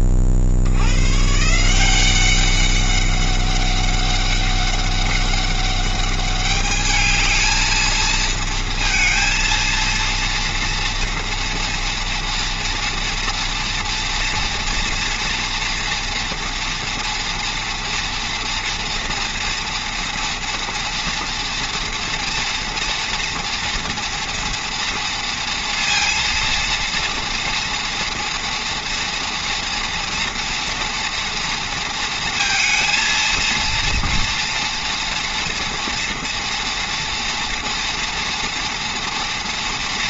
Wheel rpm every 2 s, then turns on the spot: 60, 200, 200, 210, 230, 230, 230, 240, 230, 230, 240, 230, 230, 230, 230, 230, 230, 240, 230, 230.
none